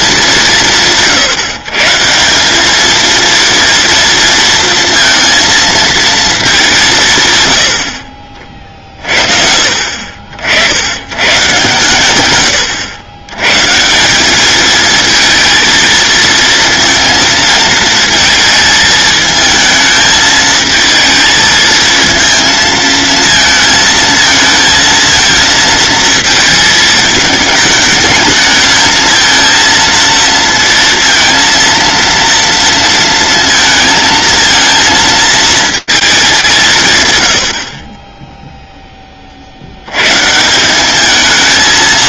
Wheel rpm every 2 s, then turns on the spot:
160, 210, 230, 160, 40, 90, 100, 220, 230, 220, 220, 230, 230, 220, 220, 230, 230, 220, 150, 10, 210.
none